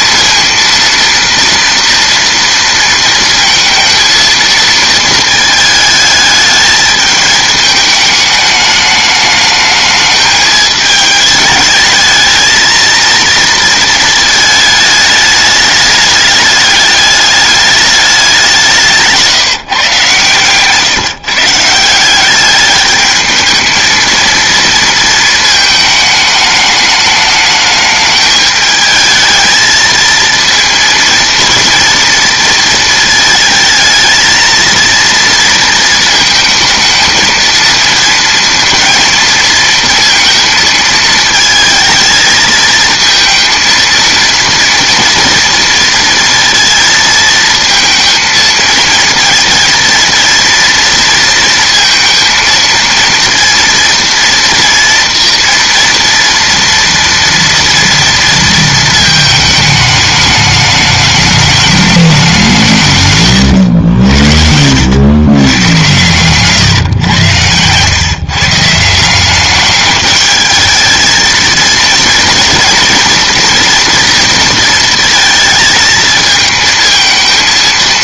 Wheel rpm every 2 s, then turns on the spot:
230, 230, 230, 220, 210, 210, 230, 220, 210, 180, 140, 210, 230, 210, 210, 230, 230, 230, 220, 230, 220, 220, 230, 230, 230, 230, 230, 230, 230, 230, 210, 170, 90, 130, 160, 220, 230, 230, 220.
none